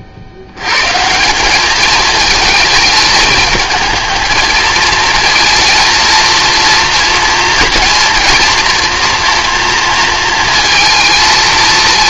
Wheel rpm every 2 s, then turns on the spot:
130, 220, 220, 230, 240, 230.
none